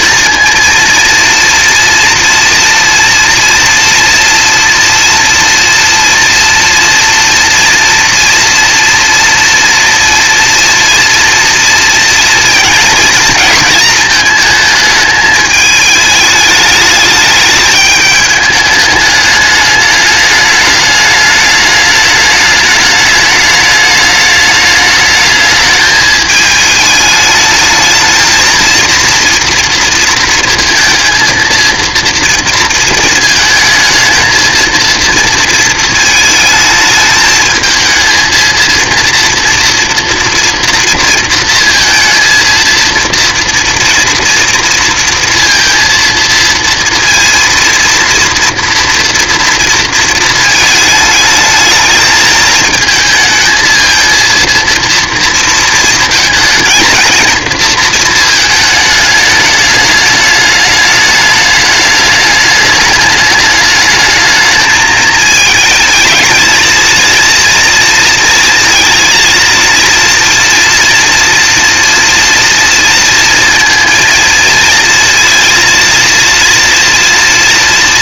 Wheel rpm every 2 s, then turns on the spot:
230, 240, 230, 240, 230, 230, 230, 220, 210, 210, 210, 210, 210, 210, 230, 230, 220, 230, 220, 230, 230, 230, 230, 230, 230, 220, 220, 230, 220, 220, 210, 210, 220, 230, 230, 230, 230, 230, 230.
none